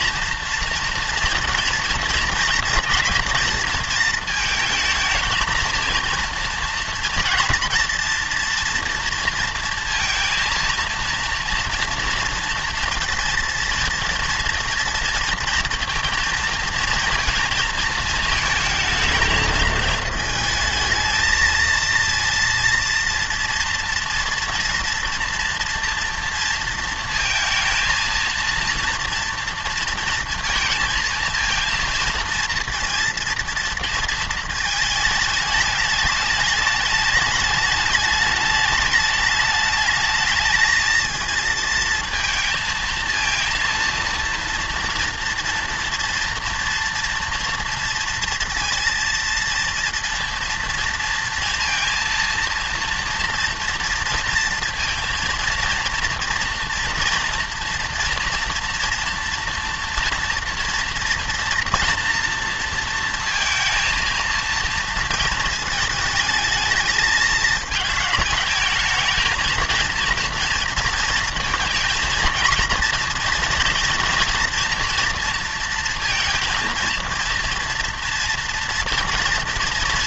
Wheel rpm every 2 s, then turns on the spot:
230, 230, 220, 230, 230, 230, 230, 230, 230, 230, 220, 230, 230, 230, 230, 230, 230, 220, 220, 210, 220, 230, 230, 230, 230, 230, 230, 230, 230, 230, 240, 230, 230, 220, 220, 230, 230, 230, 230, 230.
none